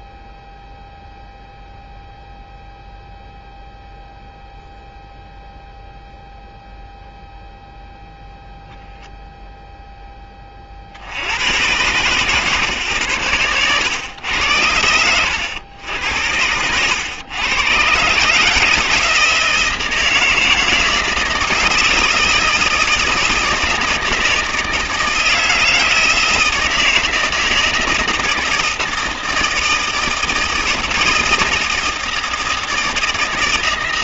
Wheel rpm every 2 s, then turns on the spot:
0, 0, 0, 0, 0, 30, 120, 90, 100, 160, 160, 170, 160, 160, 160, 160, 160.
14-16